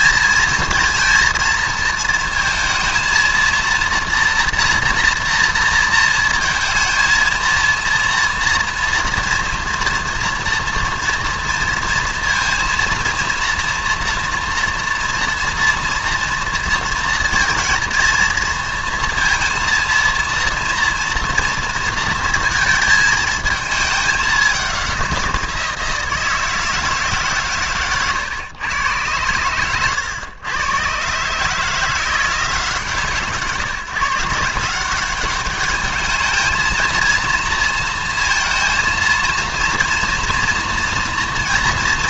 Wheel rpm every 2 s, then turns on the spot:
220, 230, 230, 230, 230, 230, 230, 230, 230, 230, 230, 220, 200, 160, 140, 110, 170, 170, 220, 230, 230.
none